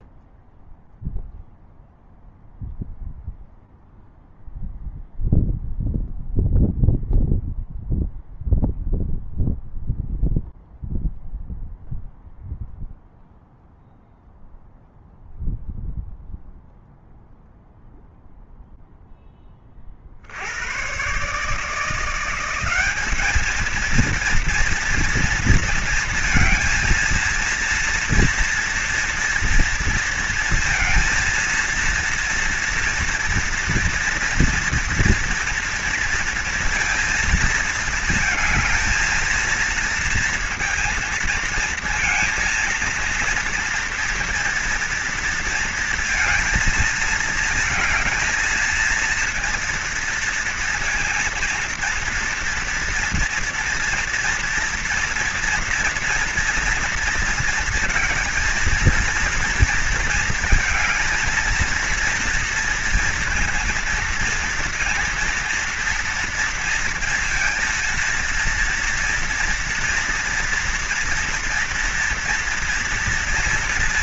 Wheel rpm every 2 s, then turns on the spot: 0, 0, 0, 0, 0, 0, 0, 0, 0, 0, 110, 200, 230, 230, 230, 230, 230, 230, 230, 220, 230, 230, 240, 220, 230, 230, 230, 230, 230, 230, 220, 230, 230, 230, 230, 230, 230.
none